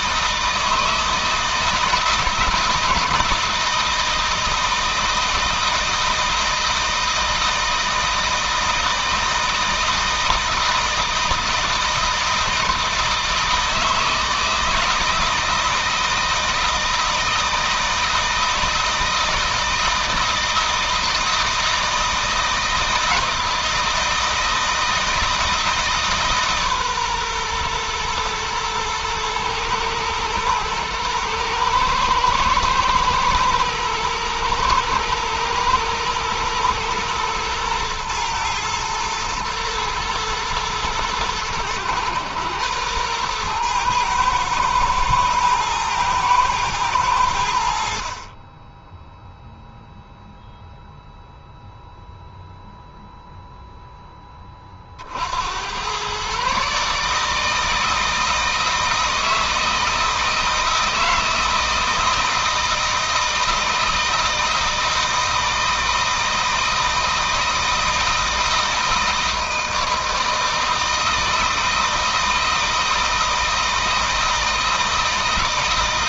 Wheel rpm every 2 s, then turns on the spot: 160, 160, 160, 160, 160, 160, 160, 160, 160, 160, 160, 160, 160, 140, 120, 120, 110, 110, 120, 110, 110, 110, 110, 110, 10, 0, 0, 30, 140, 160, 160, 160, 160, 160, 160, 160, 160, 160.
none